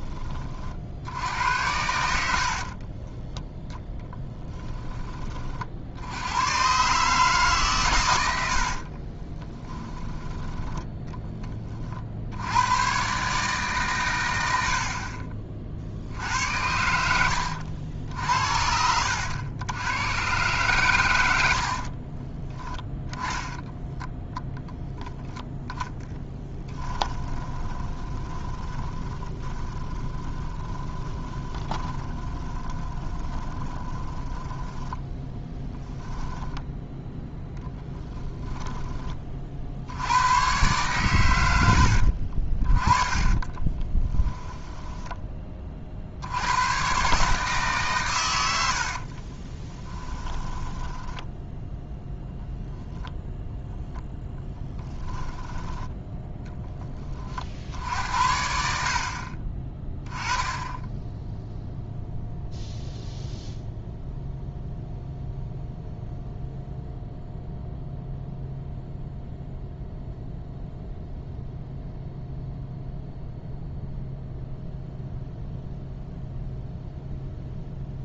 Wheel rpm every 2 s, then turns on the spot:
60, 30, 20, 140, 40, 10, 120, 50, 90, 80, 110, 10, 0, 10, 20, 10, 20, 10, 0, 20, 120, 20, 10, 130, 70, 10, 10, 10, 20, 50, 10, 0, 0, 0, 0, 0, 0, 0, 0.
2-4 8-10 16-20 26-36 42-46 48-52 54-56